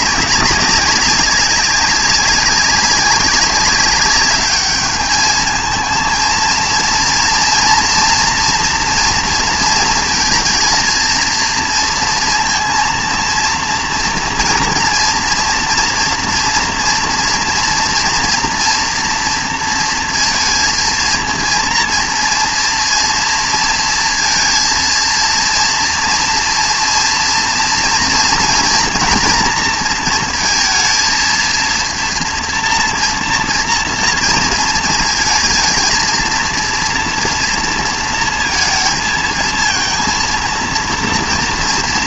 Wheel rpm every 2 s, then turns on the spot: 200, 190, 210, 230, 230, 230, 230, 230, 230, 230, 230, 230, 230, 230, 230, 230, 230, 230, 230, 230, 230.
none